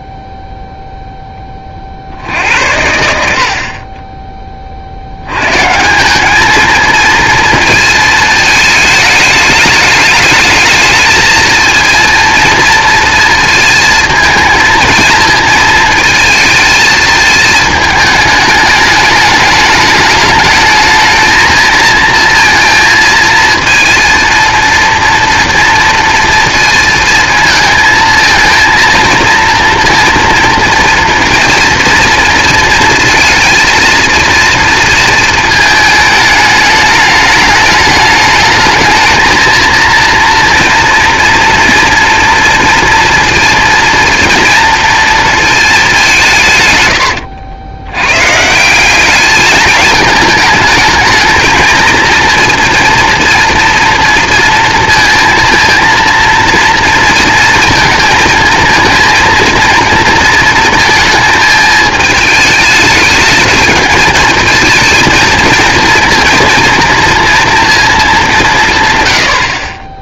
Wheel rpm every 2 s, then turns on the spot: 0, 80, 30, 220, 220, 220, 230, 230, 230, 210, 220, 230, 230, 230, 230, 230, 230, 230, 210, 220, 230, 230, 230, 130, 170, 220, 230, 230, 230, 220, 230, 210, 220, 230, 170.
none